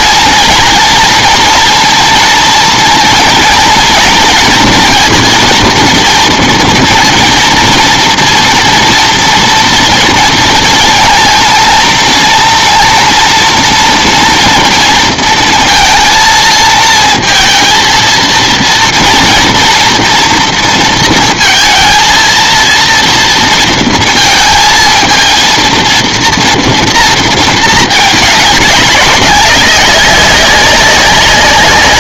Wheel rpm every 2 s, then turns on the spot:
230, 240, 230, 230, 230, 230, 230, 230, 230, 230, 230, 230, 230, 230, 200, 190.
none